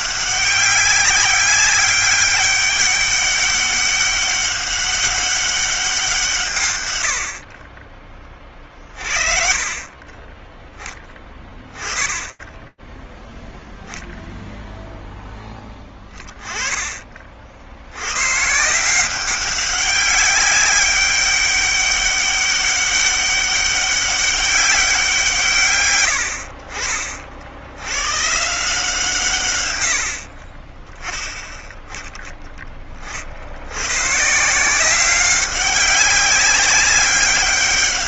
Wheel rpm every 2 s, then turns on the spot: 200, 200, 200, 100, 30, 10, 0, 0, 30, 180, 200, 200, 180, 60, 150, 10, 40, 180, 200.
none